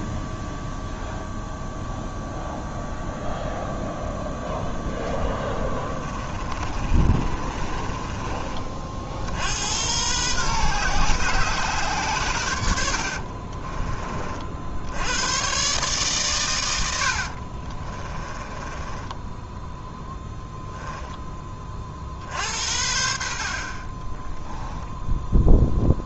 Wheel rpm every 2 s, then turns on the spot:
0, 0, 0, 30, 30, 130, 90, 60, 110, 20, 0, 60, 10.
6-8 18-20 24-26